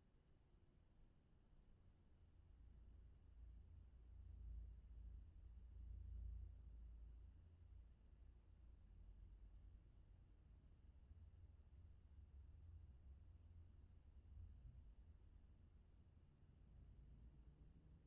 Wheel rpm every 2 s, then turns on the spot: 0, 0, 0, 0, 0, 0, 0, 0, 0.
none